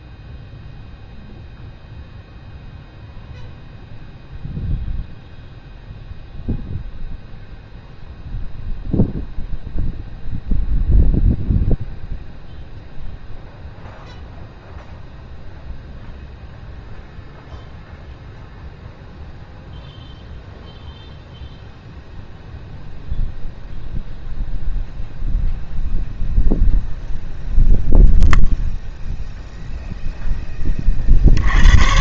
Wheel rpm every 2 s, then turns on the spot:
0, 0, 0, 0, 0, 0, 0, 0, 0, 0, 0, 0, 0, 0, 0, 20.
none